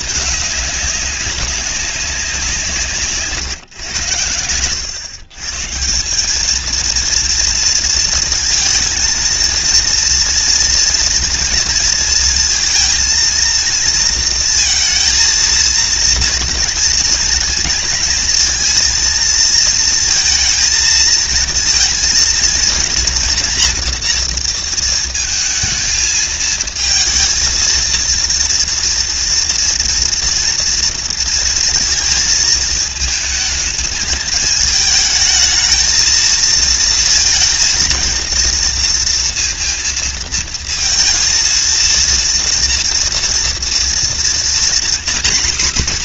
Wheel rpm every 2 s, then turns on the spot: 200, 140, 120, 230, 230, 230, 230, 230, 230, 230, 230, 240, 230, 230, 230, 230, 220, 220, 230, 230, 230, 230, 260.
2-4